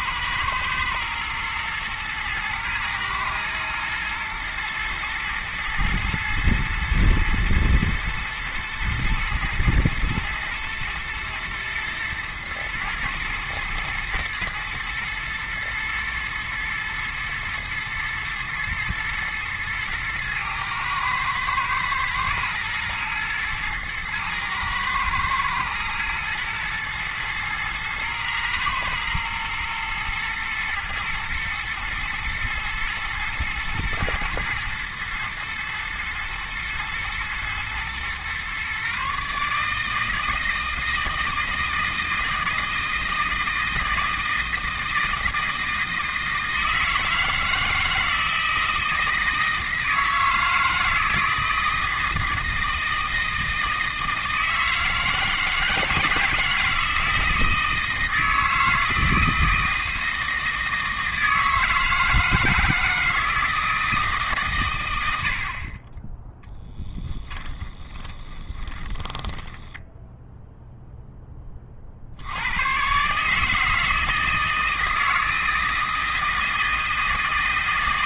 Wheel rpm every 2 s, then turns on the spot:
120, 110, 110, 120, 120, 110, 110, 120, 110, 110, 110, 120, 110, 110, 110, 120, 120, 110, 120, 140, 160, 160, 160, 160, 170, 160, 160, 160, 160, 160, 160, 160, 110, 10, 20, 0, 120, 160, 160.
66-70